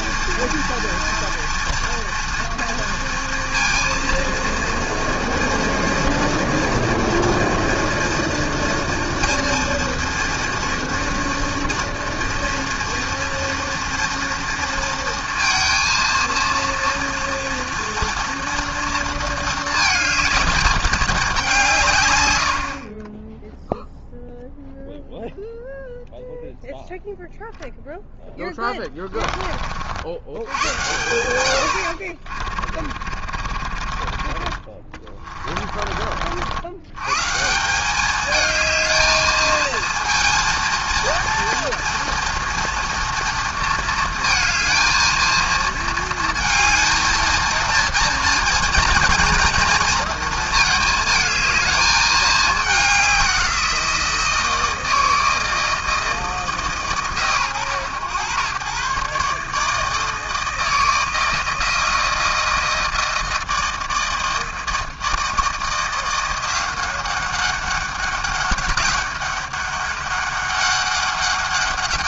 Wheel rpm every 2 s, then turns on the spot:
230, 230, 230, 230, 230, 230, 230, 230, 230, 230, 210, 40, 0, 0, 10, 100, 40, 30, 110, 220, 230, 230, 230, 220, 230, 220, 200, 160, 130, 120, 160, 160, 160, 190, 200, 200.
28-30 32-36